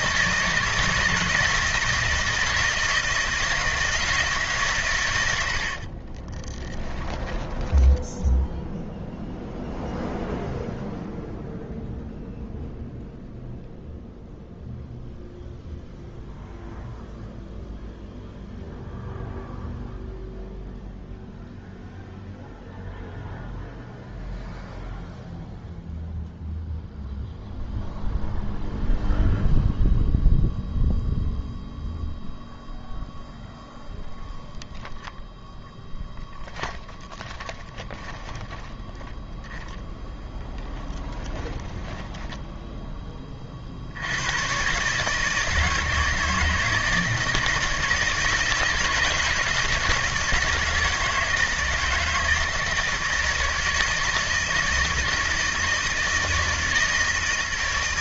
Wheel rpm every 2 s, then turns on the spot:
160, 170, 140, 10, 0, 0, 0, 0, 0, 0, 0, 0, 0, 0, 0, 0, 0, 0, 10, 10, 10, 10, 120, 160, 160, 160, 160, 160, 160.
6-8 36-38 40-42